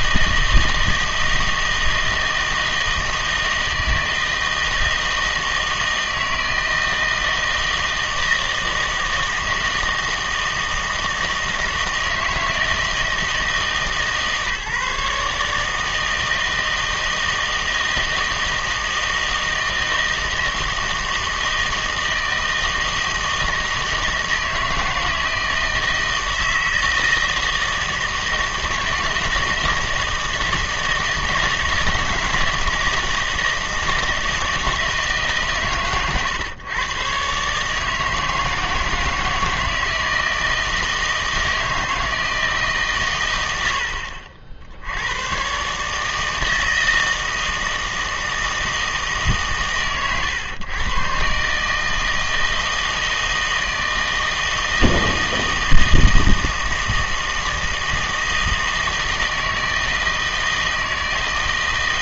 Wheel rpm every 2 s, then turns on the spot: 160, 160, 160, 160, 160, 160, 160, 150, 160, 160, 160, 160, 160, 160, 160, 160, 160, 160, 130, 160, 160, 150, 70, 160, 160, 110, 160, 160, 160, 160, 160.
none